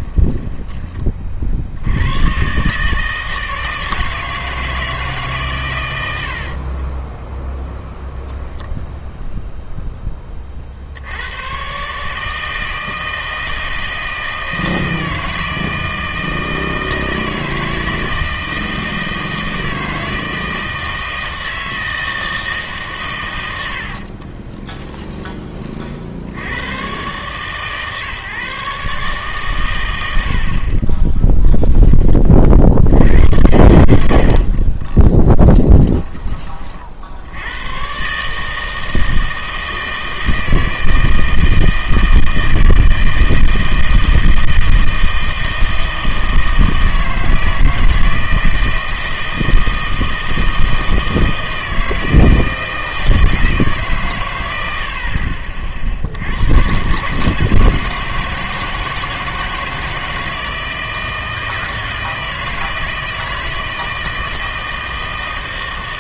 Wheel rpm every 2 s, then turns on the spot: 20, 150, 160, 30, 0, 60, 160, 160, 160, 160, 160, 140, 10, 110, 140, 40, 70, 20, 50, 160, 160, 160, 160, 160, 160, 160, 160, 70, 120, 160, 160, 160, 160.
6-8 24-26 30-32 34-36